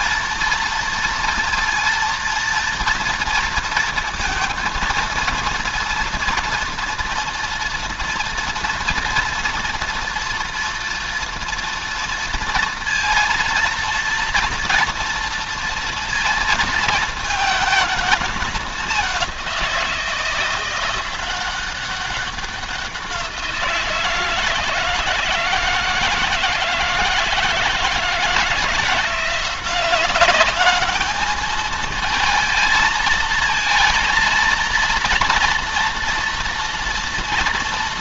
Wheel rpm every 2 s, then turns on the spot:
230, 230, 230, 230, 240, 230, 230, 230, 220, 200, 180, 180, 160, 160, 170, 210, 220, 230, 230.
none